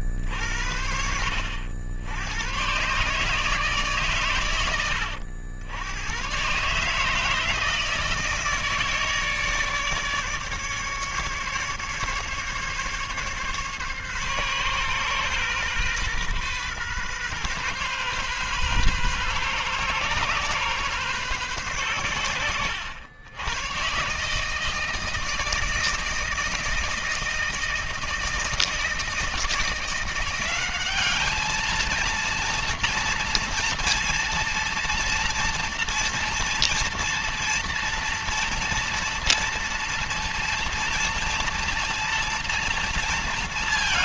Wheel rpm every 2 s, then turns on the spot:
50, 90, 130, 120, 160, 150, 140, 130, 130, 130, 130, 100, 160, 160, 160, 190, 230, 230, 240, 230, 230, 230.
none